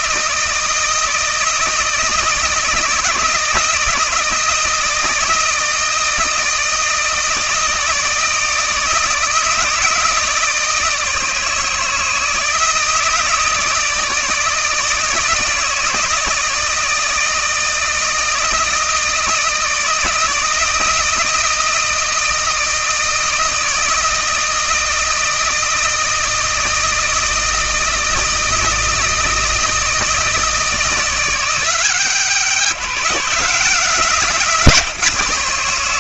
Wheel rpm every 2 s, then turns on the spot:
160, 160, 160, 160, 160, 160, 160, 160, 160, 160, 160, 160, 160, 160, 160, 160, 160, 150.
none